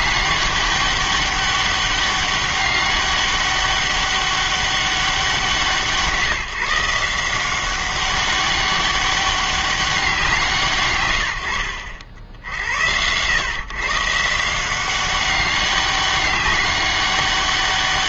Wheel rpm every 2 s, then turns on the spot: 200, 200, 200, 160, 200, 150, 80, 180, 200.
none